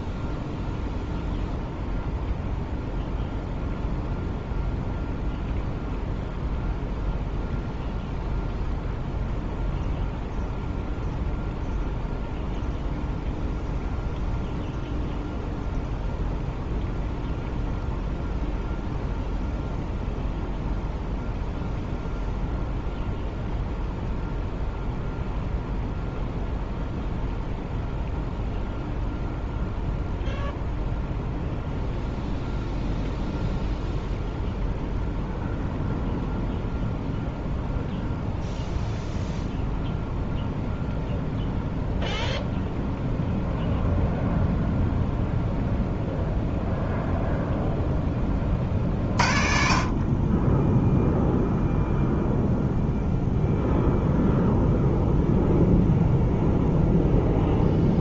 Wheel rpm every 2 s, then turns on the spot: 0, 0, 0, 0, 0, 0, 0, 0, 0, 0, 0, 0, 0, 0, 0, 0, 0, 0, 0, 0, 0, 0, 0, 0, 30, 20, 0, 0, 0.
none